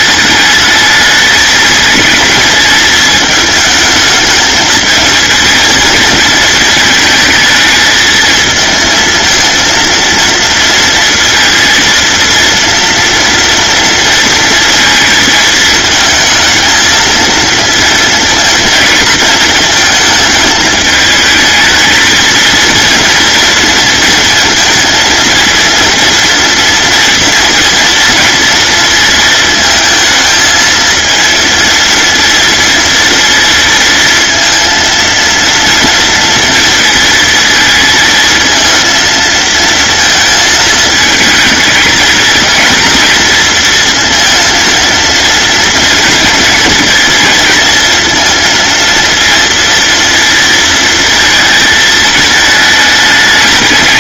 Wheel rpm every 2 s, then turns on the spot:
220, 220, 220, 220, 230, 230, 230, 220, 230, 220, 220, 230, 230, 230, 220, 230, 230, 230, 220, 230, 220, 230, 230, 230, 230, 220, 210.
none